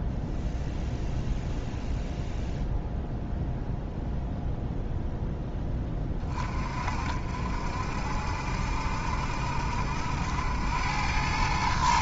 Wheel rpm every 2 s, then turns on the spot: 0, 0, 0, 40, 60, 90.
none